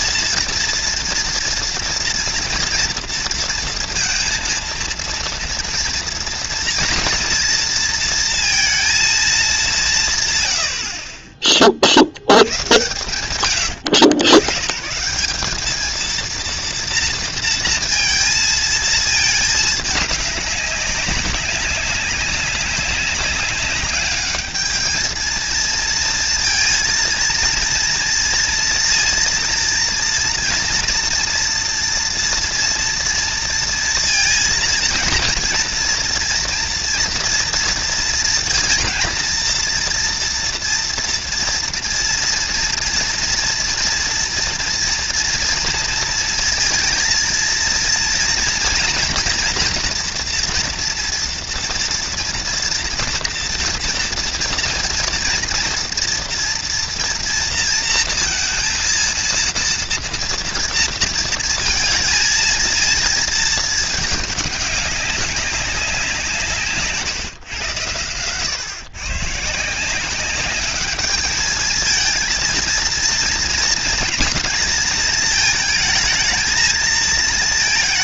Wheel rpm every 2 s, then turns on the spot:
230, 230, 230, 230, 190, 20, 100, 180, 230, 220, 190, 190, 230, 230, 230, 230, 230, 230, 230, 230, 230, 230, 230, 230, 240, 230, 230, 240, 230, 230, 230, 220, 200, 140, 120, 210, 230, 220, 220.
66-68